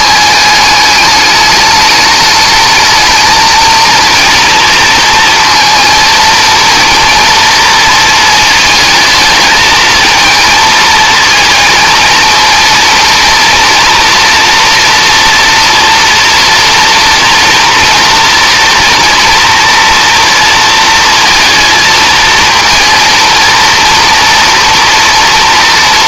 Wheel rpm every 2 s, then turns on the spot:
210, 220, 230, 230, 220, 220, 230, 230, 230, 230, 230, 230, 230.
none